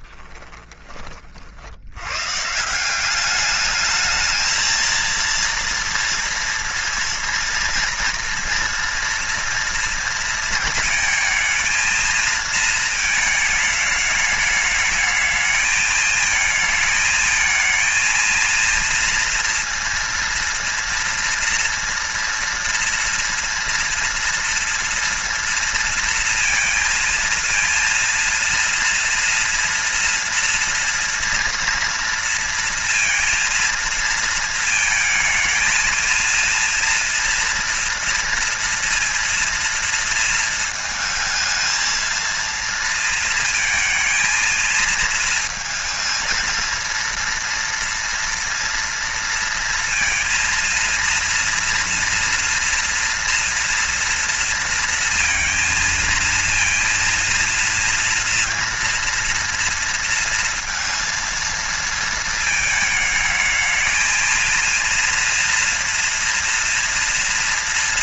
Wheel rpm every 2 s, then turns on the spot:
30, 170, 220, 230, 230, 220, 230, 220, 220, 230, 230, 230, 230, 230, 230, 230, 230, 220, 230, 230, 230, 230, 220, 230, 230, 230, 230, 230, 230, 230, 230, 220, 230, 230.
0-2